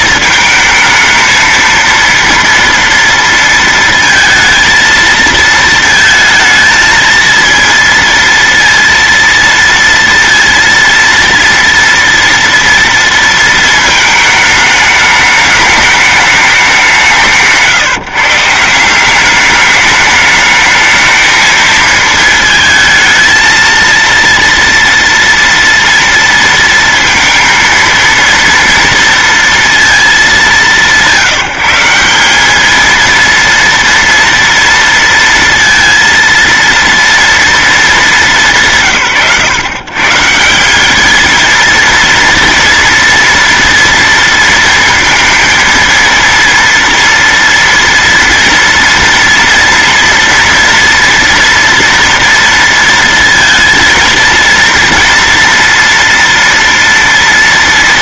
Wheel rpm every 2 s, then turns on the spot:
220, 230, 220, 220, 230, 230, 230, 210, 180, 180, 220, 220, 230, 230, 230, 180, 230, 230, 230, 150, 210, 230, 230, 230, 230, 230, 230, 230, 230.
none